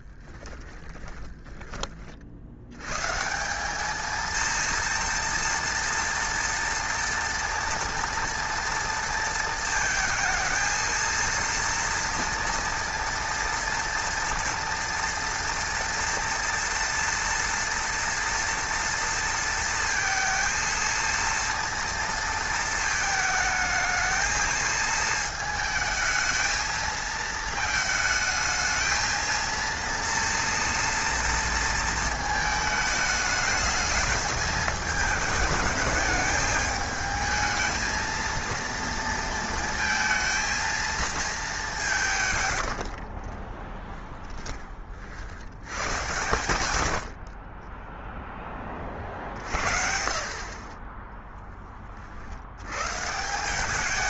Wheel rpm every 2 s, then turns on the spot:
10, 100, 230, 230, 230, 230, 230, 240, 240, 230, 230, 220, 220, 220, 220, 230, 210, 220, 220, 230, 230, 80, 40, 80, 30, 20, 140.
0-2 42-44